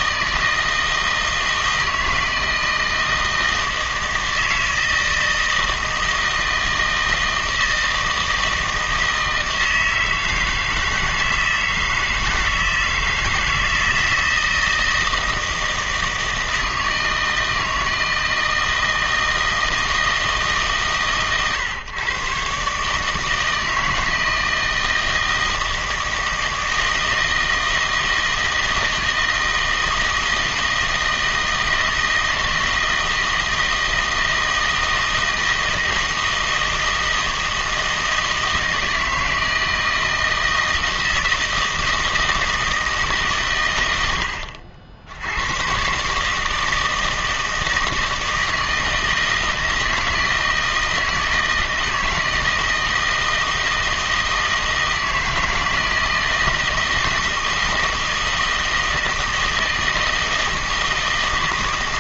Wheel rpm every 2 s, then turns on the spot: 160, 160, 160, 160, 160, 160, 160, 160, 160, 160, 140, 140, 160, 160, 160, 160, 160, 160, 160, 160, 160, 160, 70, 160, 160, 160, 160, 160, 160, 160, 160.
none